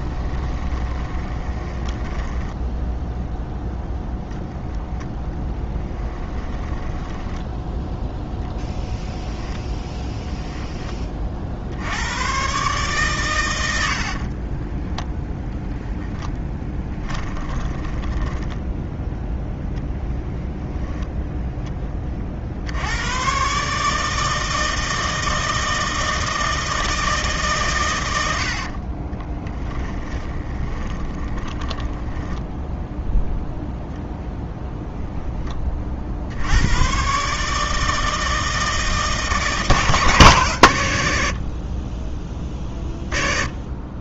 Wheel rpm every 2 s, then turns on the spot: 20, 10, 10, 10, 0, 10, 120, 20, 10, 10, 10, 60, 160, 160, 50, 20, 0, 0, 80, 160, 120, 20.
0-4 6-8 14-18 20-22 28-32